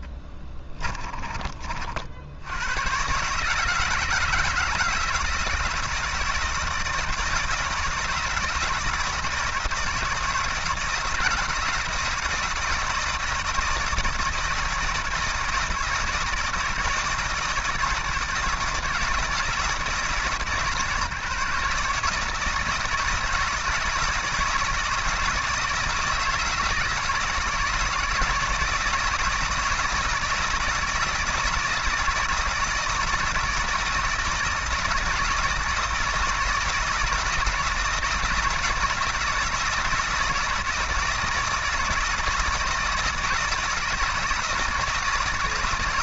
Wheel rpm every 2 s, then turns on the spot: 20, 110, 160, 160, 160, 160, 160, 160, 160, 160, 150, 160, 160, 160, 170, 160, 170, 160, 160, 160, 160, 160, 170.
0-2